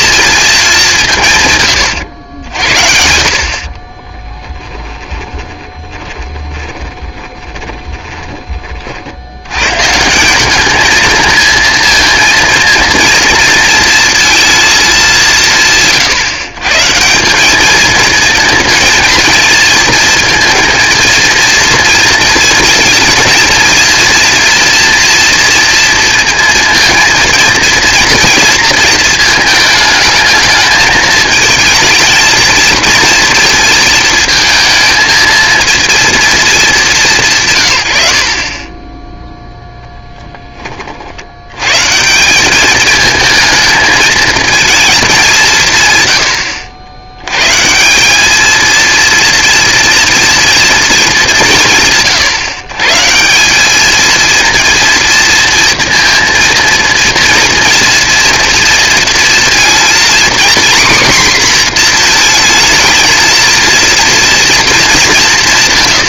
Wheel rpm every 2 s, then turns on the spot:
210, 60, 10, 20, 30, 210, 230, 220, 140, 230, 230, 230, 240, 230, 230, 220, 230, 220, 220, 20, 30, 200, 230, 80, 230, 230, 140, 230, 230, 230, 250, 220, 210.
4-8 38-40